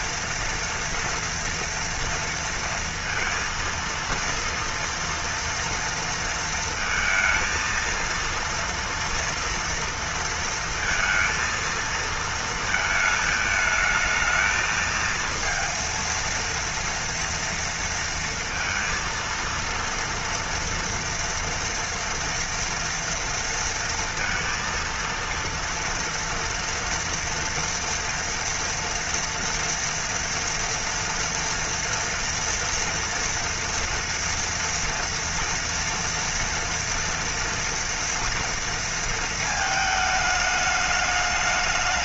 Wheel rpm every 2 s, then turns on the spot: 230, 230, 230, 230, 230, 230, 220, 220, 230, 230, 240, 240, 230, 230, 230, 230, 230, 230, 240, 230, 210.
none